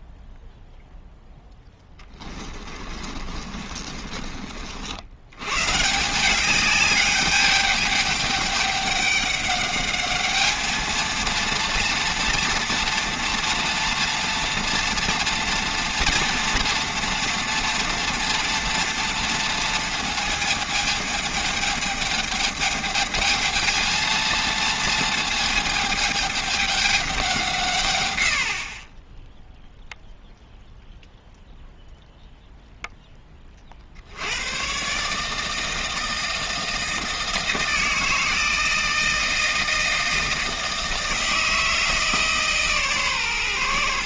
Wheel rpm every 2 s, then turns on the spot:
0, 20, 70, 210, 200, 220, 230, 230, 230, 230, 220, 220, 220, 200, 30, 0, 0, 120, 160, 160, 160, 140.
2-4